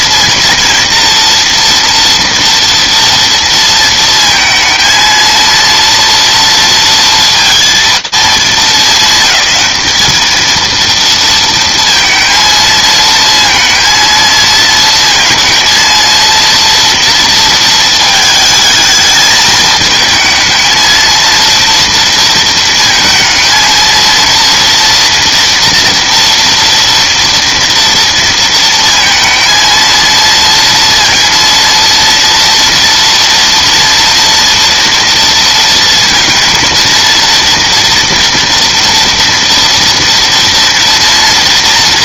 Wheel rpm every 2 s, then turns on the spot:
230, 230, 230, 230, 210, 230, 220, 230, 230, 220, 220, 230, 240, 230, 230, 230, 230, 230, 230, 230, 230.
none